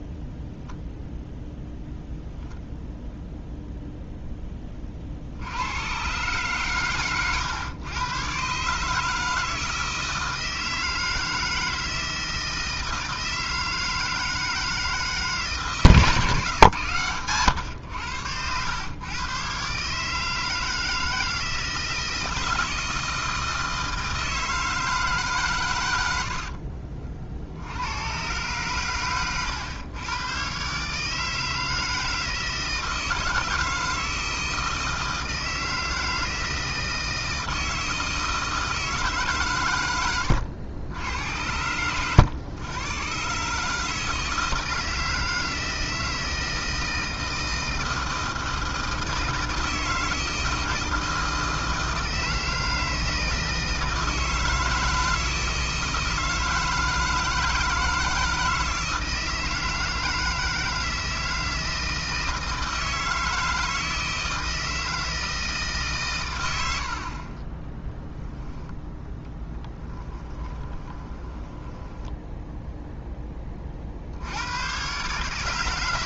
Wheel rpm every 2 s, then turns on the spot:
0, 0, 30, 130, 150, 160, 160, 160, 120, 110, 160, 160, 160, 50, 130, 130, 160, 160, 160, 160, 80, 110, 160, 160, 160, 160, 160, 160, 160, 160, 160, 160, 160, 90, 10, 20, 0, 120.
70-72